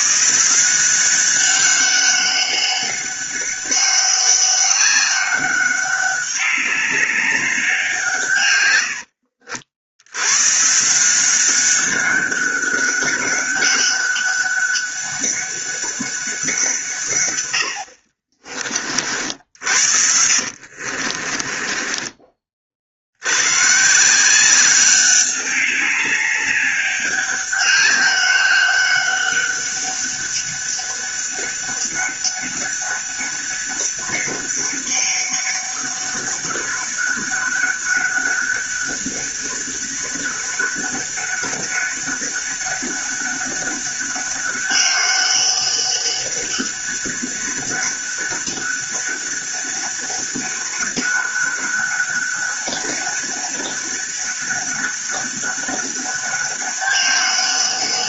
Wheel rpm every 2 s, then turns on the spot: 180, 200, 200, 200, 100, 150, 200, 200, 150, 40, 50, 60, 190, 200, 200, 200, 200, 200, 200, 200, 200, 200, 200, 200, 200, 200, 200, 200, 200.
20-22